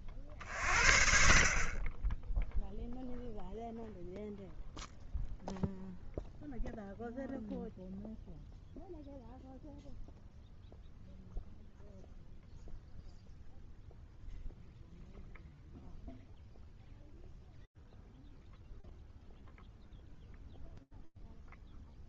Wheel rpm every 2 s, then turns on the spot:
50, 0, 0, 0, 0, 0, 0, 0, 0, 0, 0.
none